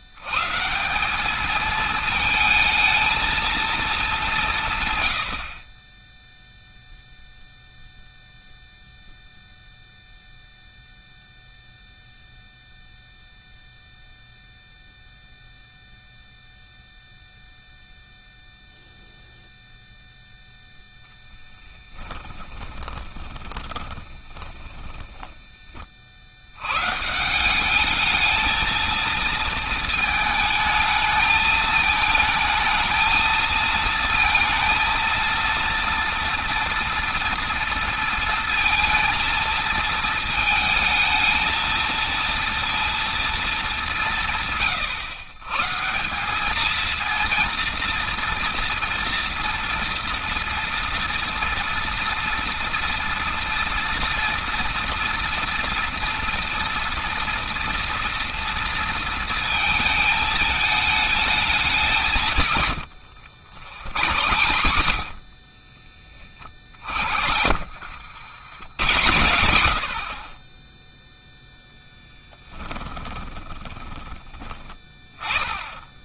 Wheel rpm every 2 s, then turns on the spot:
160, 220, 160, 0, 0, 0, 0, 0, 0, 0, 0, 20, 10, 110, 220, 220, 220, 230, 240, 230, 220, 230, 140, 220, 230, 230, 230, 230, 230, 230, 220, 110, 70, 50, 110, 10, 10, 20.
22-26 64-66 72-74